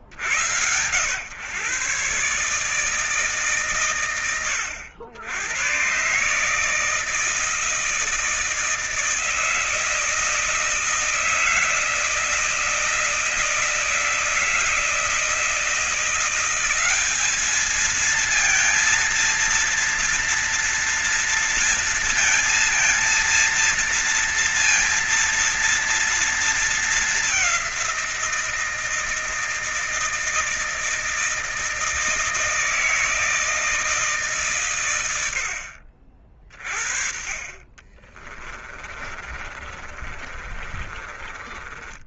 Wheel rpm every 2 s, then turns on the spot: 40, 130, 110, 130, 160, 160, 160, 160, 170, 220, 230, 230, 230, 230, 180, 160, 160, 150, 40, 30, 30.
38-42